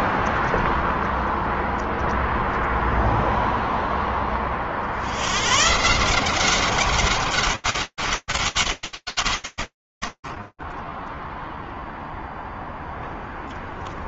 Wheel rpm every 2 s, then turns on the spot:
0, 0, 30, 180, 190, 70, 0.
none